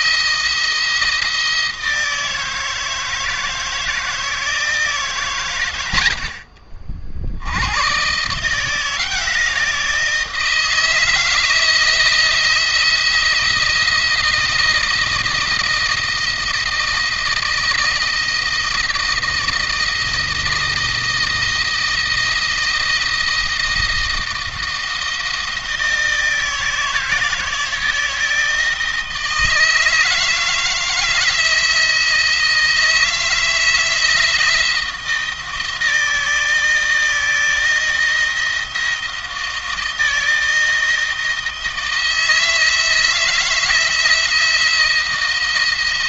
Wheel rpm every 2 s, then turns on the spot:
160, 160, 150, 50, 160, 160, 170, 160, 160, 170, 160, 160, 160, 160, 160, 160, 160, 160, 160, 170, 160, 160, 170.
none